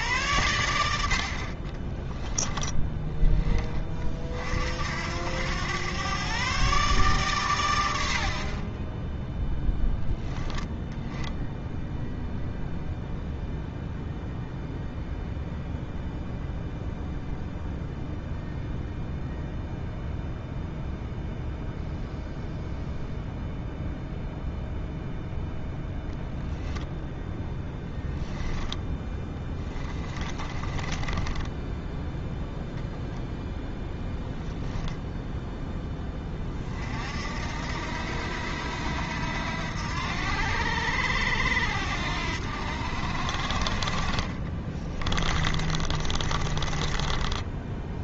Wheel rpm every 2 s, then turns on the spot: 90, 10, 60, 140, 30, 10, 0, 0, 0, 0, 0, 0, 0, 0, 10, 20, 0, 10, 40, 80, 80, 70, 30, 20.
8-10 28-32 34-36 44-48